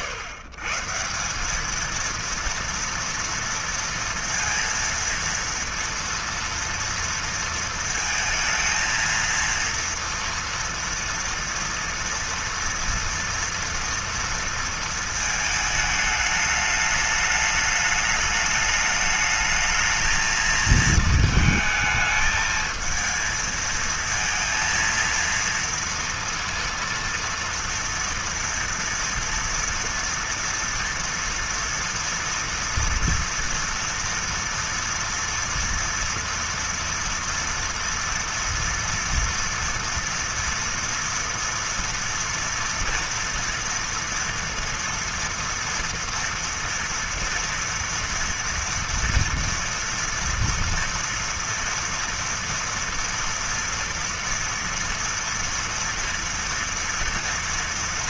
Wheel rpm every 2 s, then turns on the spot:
140, 230, 230, 230, 230, 230, 230, 230, 210, 210, 220, 220, 230, 230, 240, 230, 230, 230, 230, 230, 230, 230, 230, 230, 230, 230, 230, 230, 230.
none